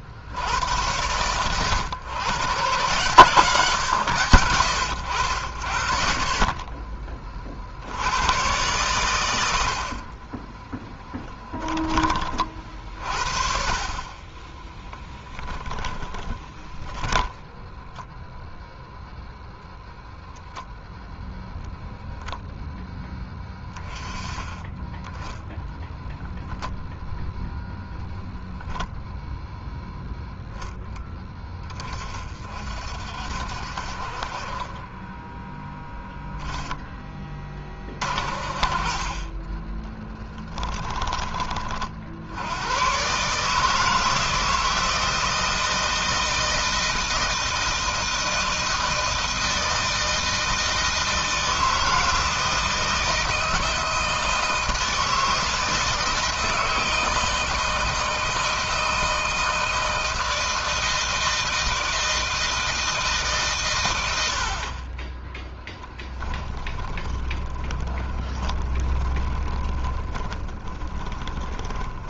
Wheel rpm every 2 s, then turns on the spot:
90, 130, 90, 20, 110, 20, 30, 20, 20, 0, 10, 10, 10, 0, 0, 0, 50, 30, 0, 40, 20, 100, 160, 160, 160, 160, 160, 160, 160, 160, 160, 160, 50, 20, 20, 20.
10-12 14-18 40-42 66-72